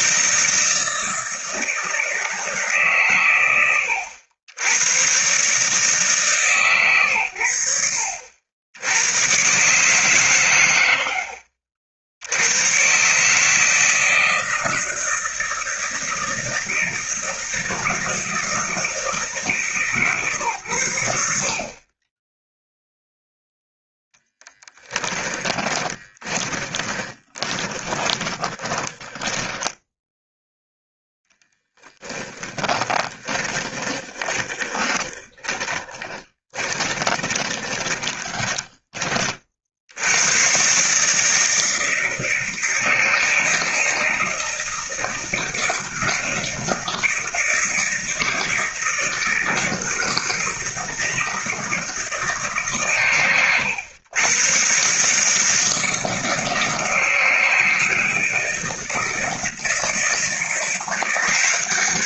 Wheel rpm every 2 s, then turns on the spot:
160, 140, 110, 120, 100, 90, 120, 160, 160, 160, 100, 0, 10, 20, 10, 0, 20, 20, 20, 20, 140, 160, 160, 160, 160, 160, 130, 140, 160, 160, 170.
24-30 32-38